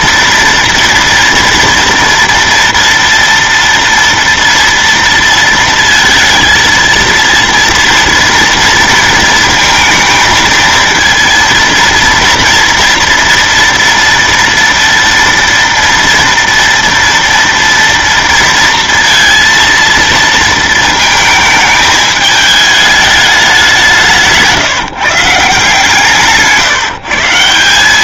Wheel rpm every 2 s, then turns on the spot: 230, 230, 230, 230, 230, 230, 240, 230, 240, 230, 230, 210, 150, 150.
26-28